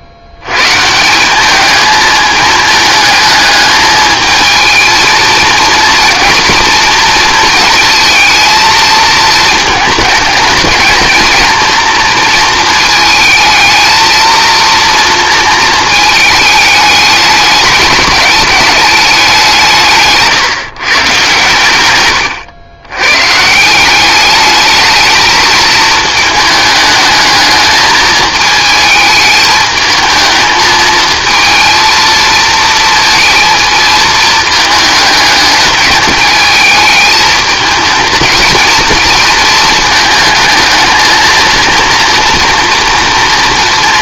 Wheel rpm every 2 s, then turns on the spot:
110, 220, 220, 230, 220, 220, 220, 230, 210, 210, 150, 110, 210, 210, 220, 220, 220, 220, 210, 230, 220, 240.
none